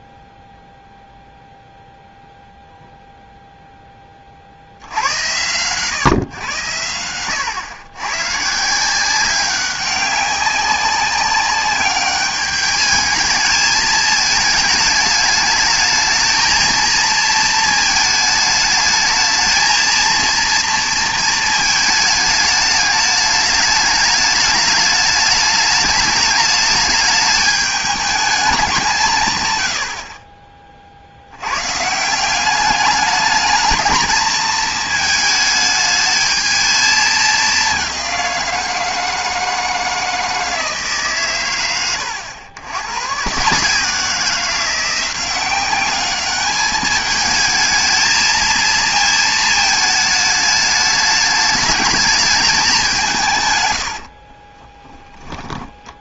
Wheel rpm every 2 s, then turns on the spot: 0, 0, 80, 100, 160, 190, 210, 210, 220, 220, 230, 210, 210, 210, 190, 30, 190, 220, 220, 170, 160, 110, 180, 210, 230, 210, 190, 20.
54-56